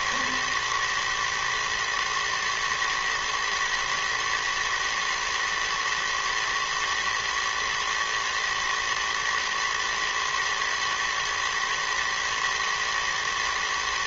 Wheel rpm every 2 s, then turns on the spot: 110, 120, 110, 110, 120, 110, 110.
none